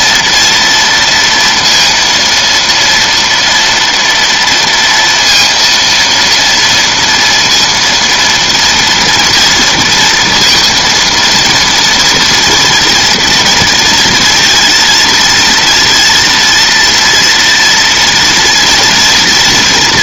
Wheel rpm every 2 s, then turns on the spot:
230, 230, 230, 230, 230, 230, 240, 230, 230, 230.
none